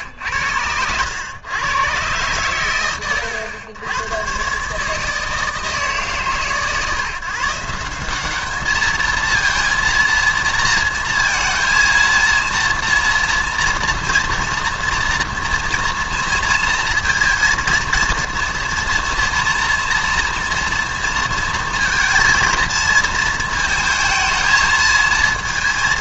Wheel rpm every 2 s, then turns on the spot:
90, 110, 140, 130, 210, 230, 230, 230, 230, 230, 240, 230, 220.
none